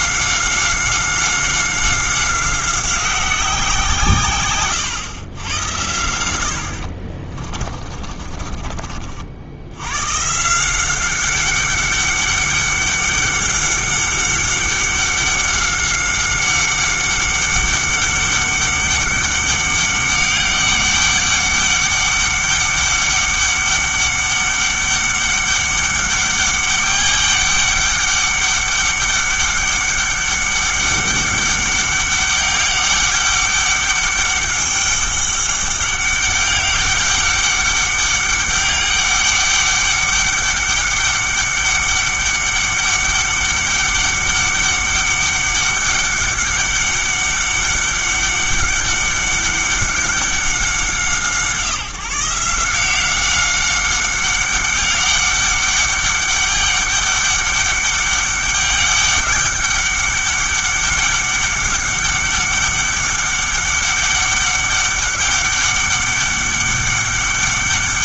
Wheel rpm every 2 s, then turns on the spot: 190, 190, 120, 60, 40, 180, 200, 200, 190, 200, 200, 200, 200, 200, 200, 200, 200, 200, 200, 200, 200, 200, 200, 200, 200, 180, 170, 200, 200, 200, 200, 200, 200, 200.
6-8